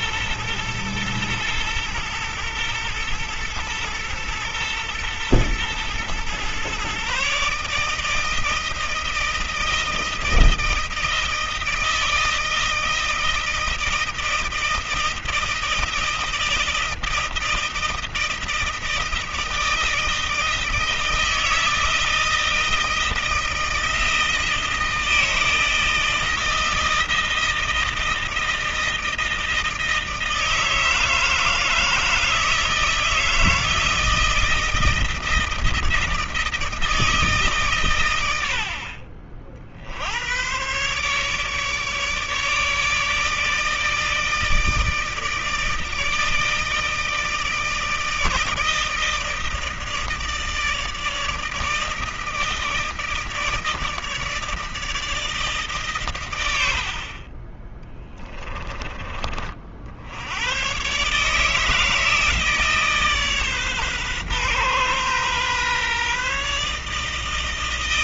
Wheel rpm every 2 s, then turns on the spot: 110, 110, 110, 130, 160, 160, 160, 160, 160, 160, 160, 160, 160, 160, 160, 160, 160, 160, 160, 60, 130, 150, 160, 160, 160, 160, 160, 160, 70, 20, 120, 150, 130, 150.
none